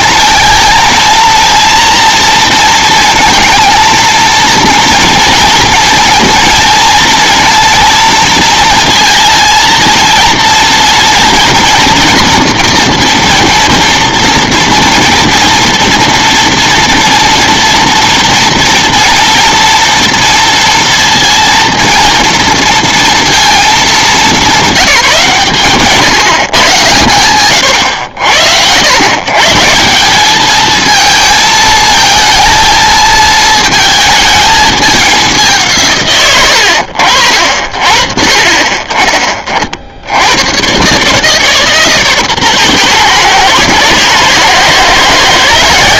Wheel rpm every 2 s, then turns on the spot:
230, 230, 230, 230, 220, 230, 230, 230, 230, 230, 230, 230, 200, 120, 90, 220, 220, 210, 100, 30, 120, 120, 120.
none